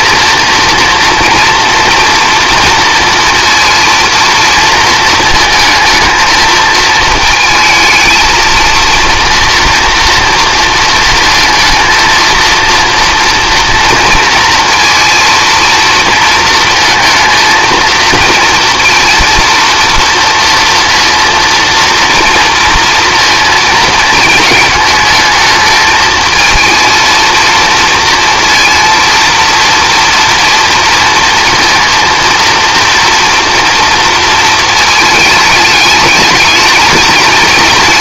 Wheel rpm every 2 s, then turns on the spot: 230, 230, 230, 220, 230, 230, 230, 230, 230, 230, 230, 230, 220, 230, 230, 230, 240, 220, 220.
none